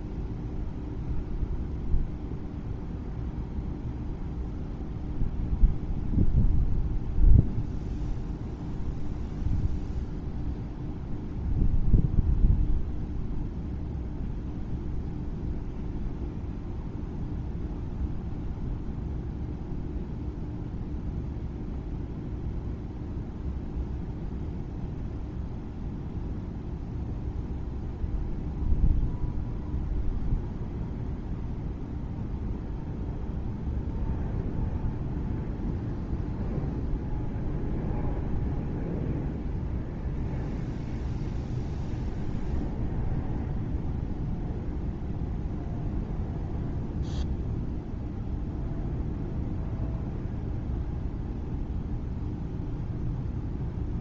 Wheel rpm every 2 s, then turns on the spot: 0, 0, 0, 0, 0, 0, 0, 0, 0, 0, 0, 0, 0, 0, 0, 0, 0, 0, 0, 0, 0, 0, 0, 0, 0, 0, 0.
none